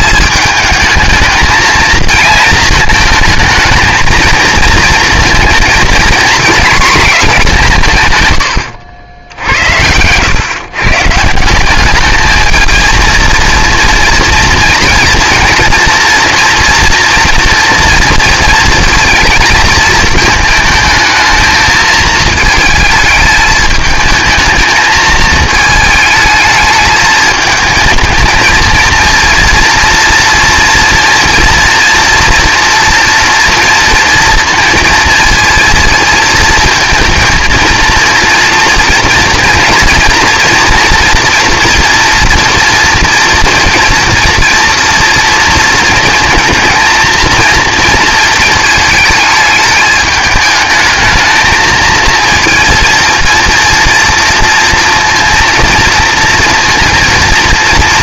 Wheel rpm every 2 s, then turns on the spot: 210, 220, 230, 240, 110, 130, 220, 230, 240, 230, 220, 220, 220, 220, 230, 230, 230, 230, 230, 230, 230, 230, 230, 230, 220, 210, 230, 230, 230.
none